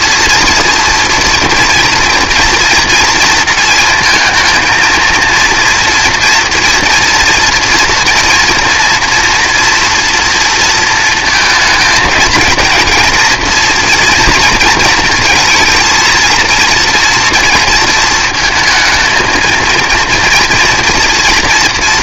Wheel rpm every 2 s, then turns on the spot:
230, 230, 220, 230, 230, 230, 230, 230, 230, 220, 230.
none